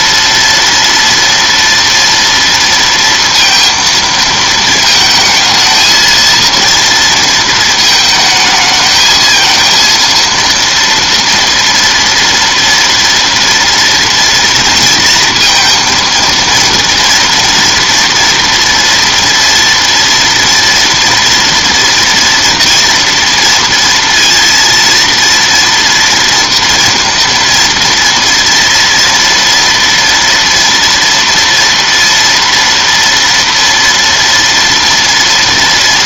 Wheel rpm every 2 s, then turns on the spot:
230, 230, 220, 230, 220, 230, 230, 230, 230, 230, 230, 230, 230, 230, 230, 230, 230, 230.
none